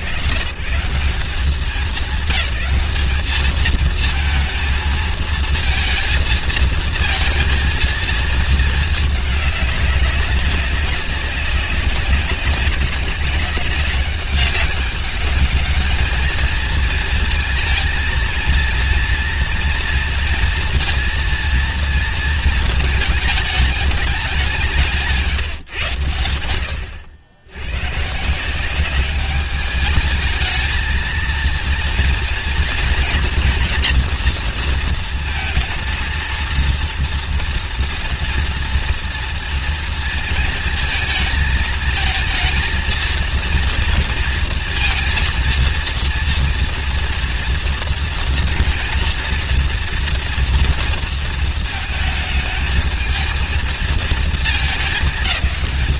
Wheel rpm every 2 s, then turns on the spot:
110, 200, 230, 220, 210, 200, 200, 200, 220, 230, 230, 220, 180, 80, 190, 220, 230, 230, 230, 230, 230, 230, 230, 230, 230, 230, 220, 220.
none